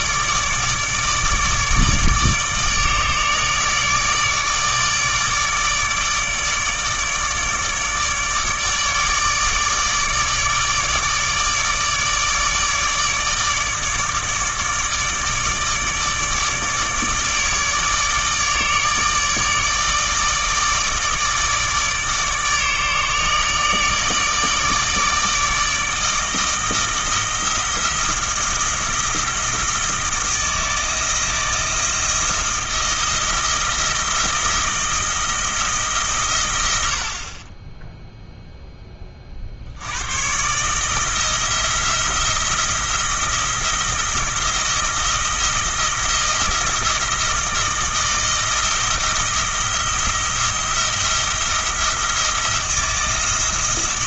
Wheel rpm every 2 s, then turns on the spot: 150, 150, 150, 150, 150, 150, 150, 150, 150, 150, 150, 150, 160, 160, 160, 160, 160, 160, 90, 10, 140, 170, 160, 160, 160, 170, 170.
none